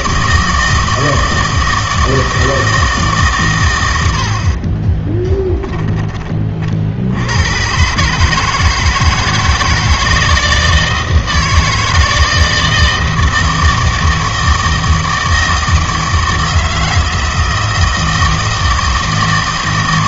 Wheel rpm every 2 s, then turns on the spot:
160, 160, 30, 40, 160, 160, 160, 160, 160, 160.
4-6